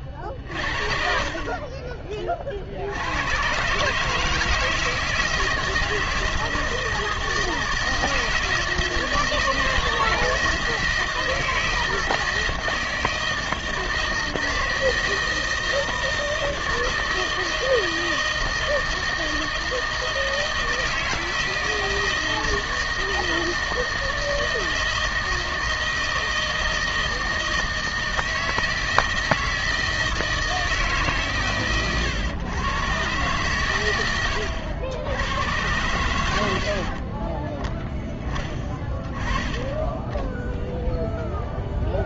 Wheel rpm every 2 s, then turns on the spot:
50, 50, 150, 160, 160, 160, 160, 160, 160, 160, 160, 160, 160, 160, 160, 160, 120, 90, 70, 10, 0.
none